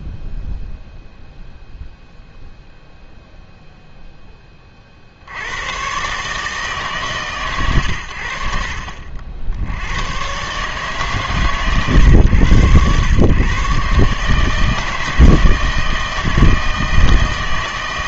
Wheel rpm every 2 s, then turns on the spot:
0, 0, 30, 150, 60, 140, 110, 160, 160.
none